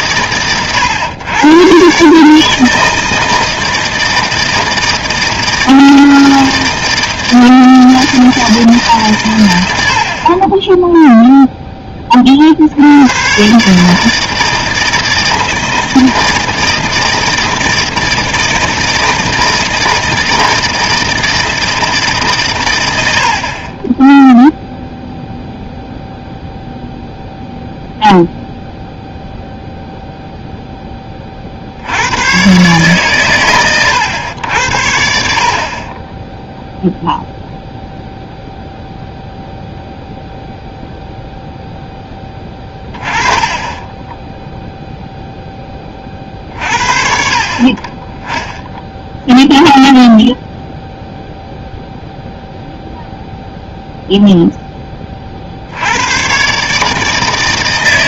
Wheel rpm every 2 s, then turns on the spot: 130, 160, 160, 160, 160, 20, 60, 160, 160, 160, 160, 130, 0, 0, 0, 0, 130, 90, 0, 0, 0, 20, 0, 50, 0, 0, 0, 0, 140.
none